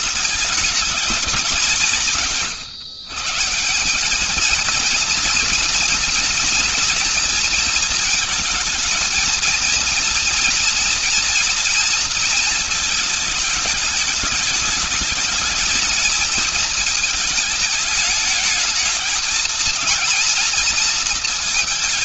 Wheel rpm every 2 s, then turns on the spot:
210, 170, 210, 230, 220, 230, 230, 210, 220, 210, 230.
none